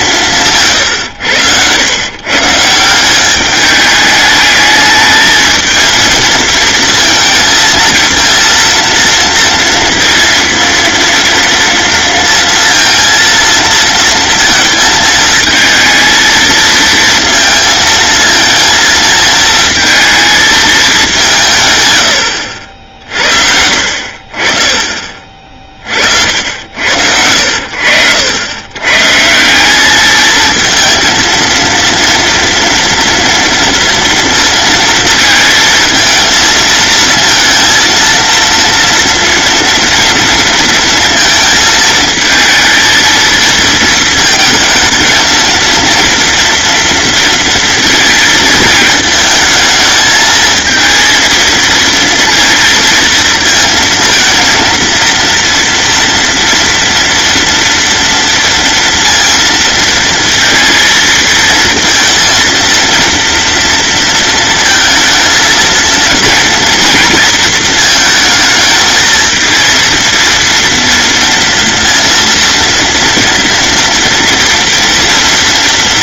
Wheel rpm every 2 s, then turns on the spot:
140, 160, 210, 230, 230, 230, 230, 230, 230, 220, 220, 70, 40, 80, 110, 220, 230, 230, 230, 230, 230, 220, 220, 230, 220, 220, 230, 230, 230, 230, 230, 230, 230, 230, 220, 240, 230, 230.
none